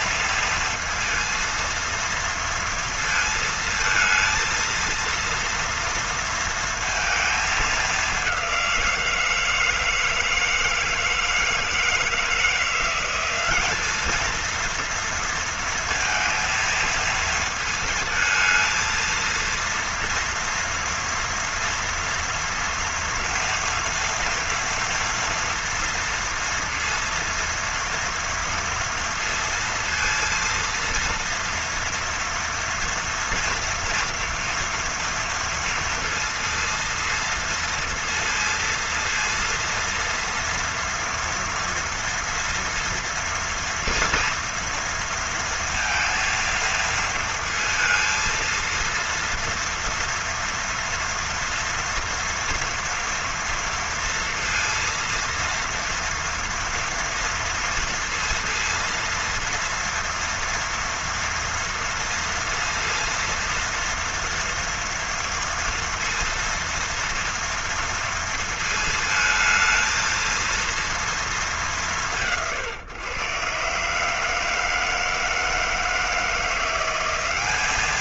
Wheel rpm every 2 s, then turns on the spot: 230, 230, 230, 230, 190, 160, 160, 220, 230, 220, 230, 240, 240, 230, 230, 230, 240, 230, 230, 230, 230, 230, 230, 230, 230, 240, 230, 230, 230, 230, 230, 230, 230, 230, 230, 230, 140, 150, 170.
none